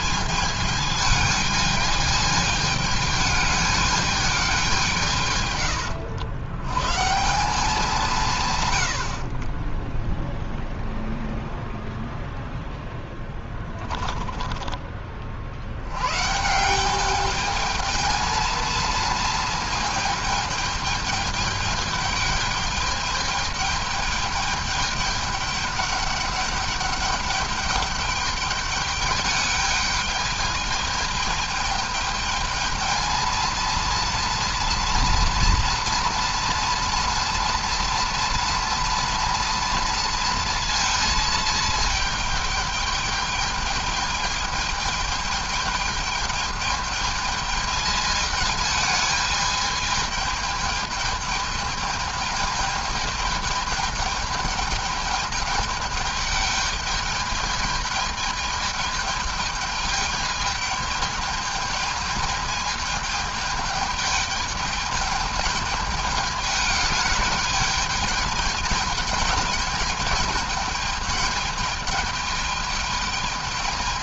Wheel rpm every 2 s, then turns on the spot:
220, 210, 170, 140, 80, 0, 0, 30, 190, 230, 220, 210, 210, 200, 210, 210, 220, 230, 230, 230, 230, 210, 210, 220, 220, 220, 220, 210, 210, 210, 210, 210, 210, 210, 210, 220, 210.
none